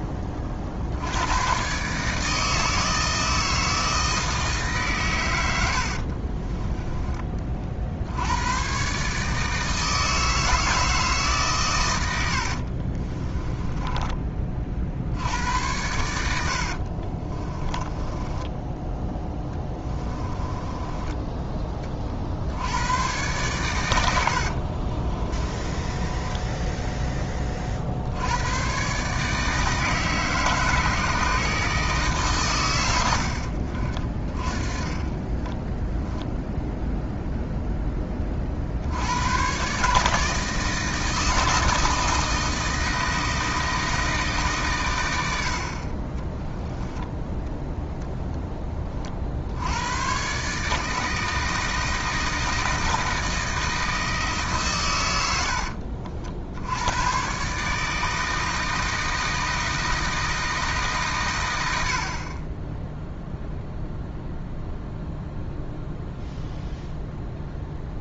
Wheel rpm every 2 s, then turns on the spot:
40, 160, 140, 20, 120, 160, 50, 40, 70, 10, 20, 90, 60, 10, 120, 150, 110, 30, 0, 70, 160, 160, 130, 10, 20, 150, 160, 130, 90, 160, 160, 10, 0, 0.
6-8 12-14 16-22 24-26 46-48